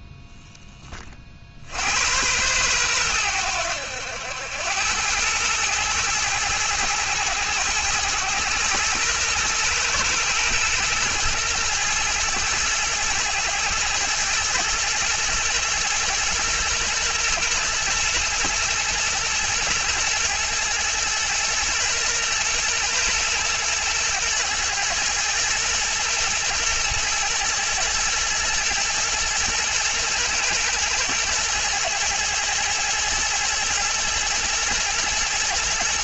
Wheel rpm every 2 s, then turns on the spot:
30, 100, 100, 110, 120, 110, 110, 120, 120, 110, 120, 110, 120, 120, 120, 110, 120, 120.
none